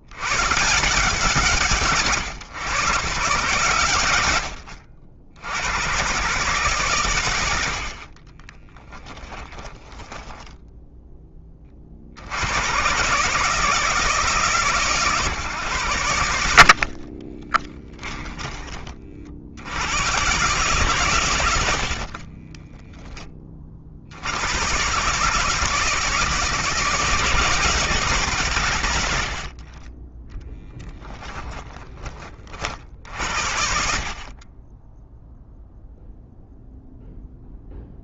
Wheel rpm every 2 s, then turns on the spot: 140, 140, 100, 130, 30, 10, 120, 150, 50, 30, 140, 20, 130, 160, 130, 10, 50, 20, 0.
8-10 16-18 22-24 30-32